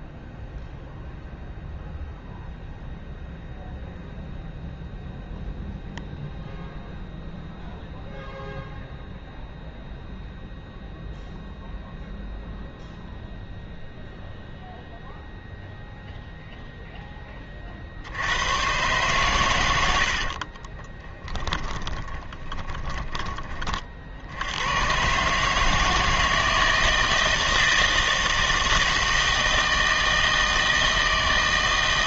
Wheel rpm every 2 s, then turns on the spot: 0, 0, 0, 0, 0, 0, 0, 0, 0, 110, 40, 20, 100, 160, 160, 160.
20-24